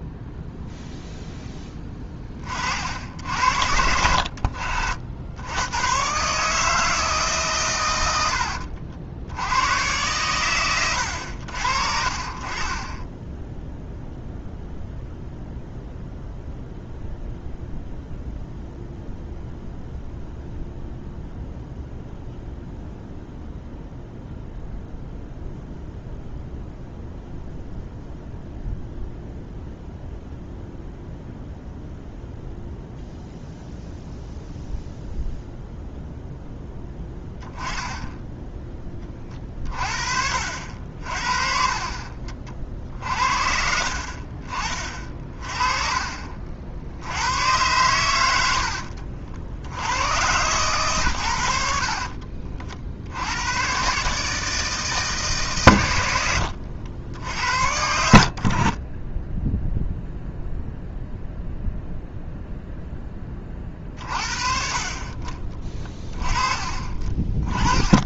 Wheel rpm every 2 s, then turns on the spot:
0, 60, 60, 160, 70, 100, 20, 0, 0, 0, 0, 0, 0, 0, 0, 0, 0, 0, 10, 20, 60, 50, 30, 70, 60, 120, 60, 160, 80, 30, 0, 10, 40, 30.
40-42 64-66